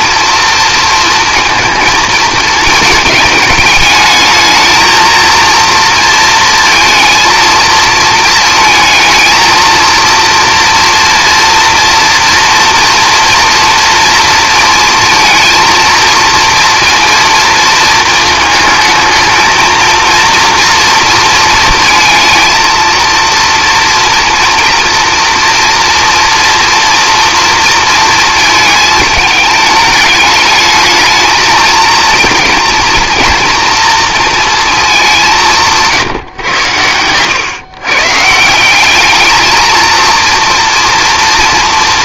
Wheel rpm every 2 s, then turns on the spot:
230, 220, 230, 230, 230, 230, 230, 230, 230, 220, 230, 230, 240, 240, 220, 220, 230, 210, 110, 200, 230.
none